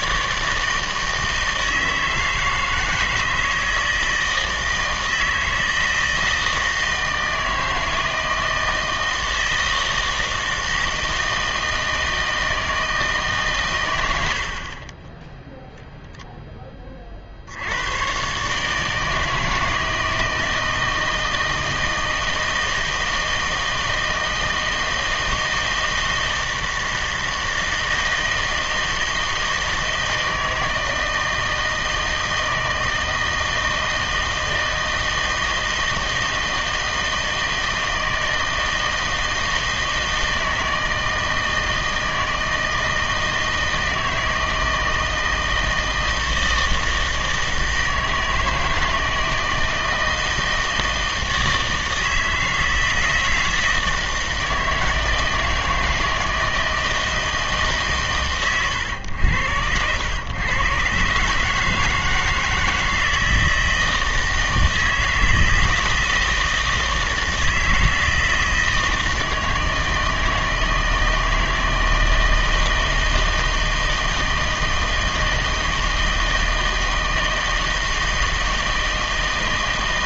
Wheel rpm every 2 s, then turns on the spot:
160, 160, 160, 160, 160, 160, 160, 50, 10, 150, 160, 160, 160, 160, 160, 160, 160, 160, 160, 160, 160, 160, 160, 160, 160, 160, 160, 160, 160, 120, 120, 160, 160, 160, 160, 160, 160, 160, 160, 160.
none